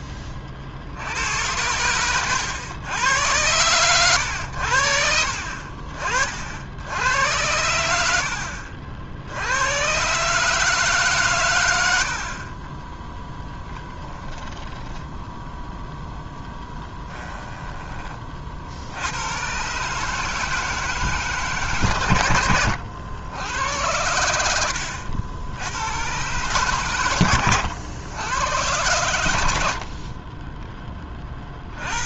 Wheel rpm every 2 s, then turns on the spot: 70, 100, 60, 80, 70, 150, 10, 10, 10, 70, 160, 90, 80, 120, 100, 20.
14-18 24-26